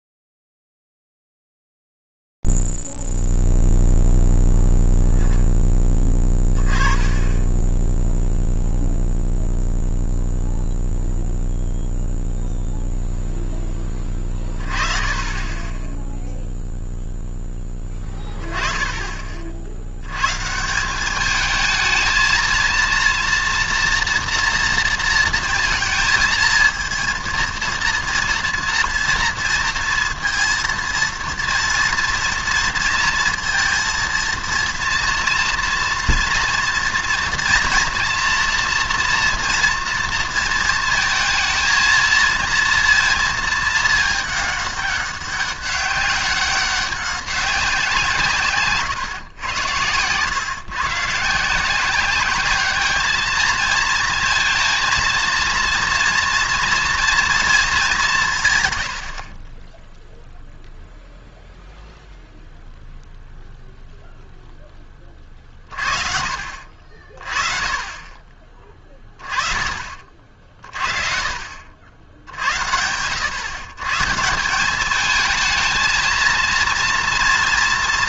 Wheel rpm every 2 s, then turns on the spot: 0, 0, 0, 10, 10, 0, 0, 20, 10, 10, 130, 230, 230, 220, 230, 230, 230, 230, 230, 230, 230, 230, 210, 190, 150, 130, 210, 230, 230, 120, 0, 0, 10, 50, 20, 50, 70, 190, 230.
none